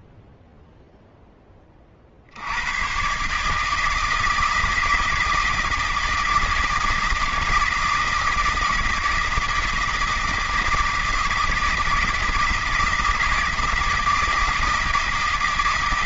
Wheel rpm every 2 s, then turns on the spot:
80, 160, 160, 160, 160, 160, 160, 160.
none